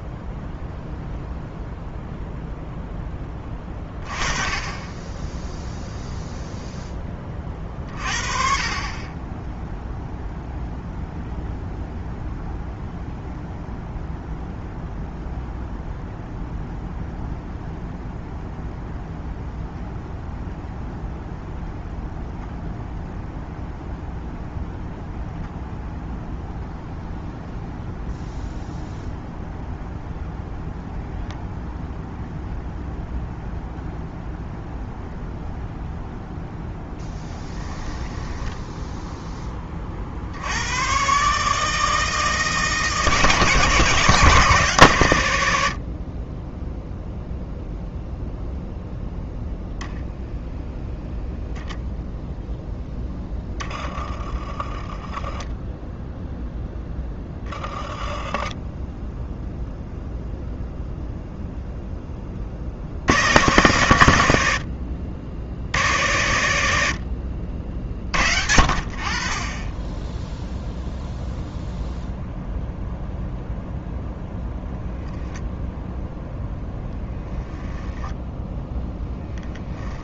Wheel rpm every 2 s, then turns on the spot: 0, 10, 20, 0, 30, 0, 0, 0, 0, 0, 0, 0, 0, 0, 0, 0, 0, 0, 0, 10, 110, 160, 130, 0, 0, 0, 10, 10, 10, 10, 0, 70, 70, 80, 60, 0, 0, 0, 0, 10.
52-54 78-80